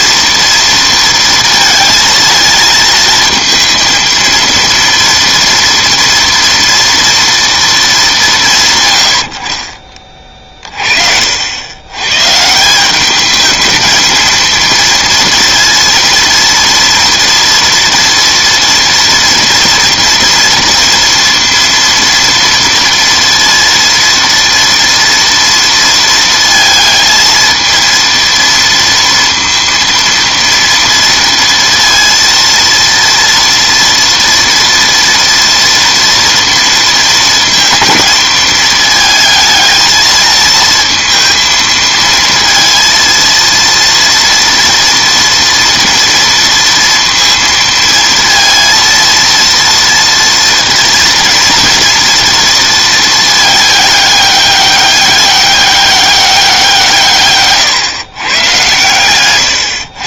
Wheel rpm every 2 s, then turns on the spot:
230, 220, 230, 230, 150, 40, 170, 230, 230, 230, 230, 230, 230, 230, 230, 230, 230, 230, 230, 220, 230, 230, 230, 230, 230, 230, 230, 200, 180, 120.
none